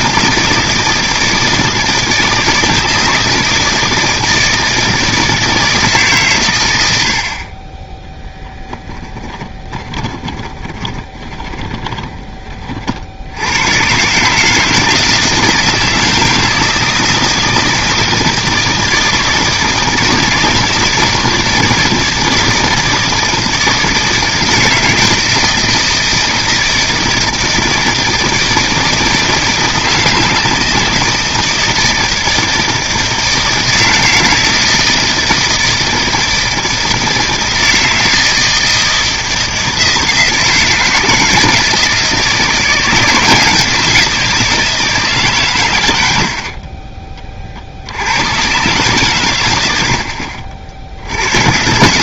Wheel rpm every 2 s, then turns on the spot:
160, 160, 160, 90, 20, 20, 50, 160, 160, 160, 160, 160, 160, 160, 160, 160, 160, 160, 160, 160, 160, 170, 160, 40, 130, 70.
8-12 46-48